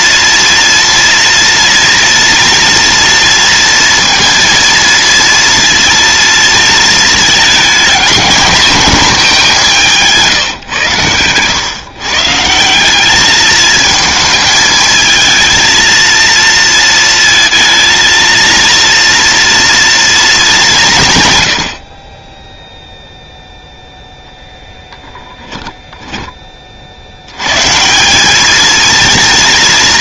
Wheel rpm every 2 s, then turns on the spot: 230, 230, 230, 230, 220, 140, 160, 220, 230, 230, 200, 10, 0, 20, 210.
none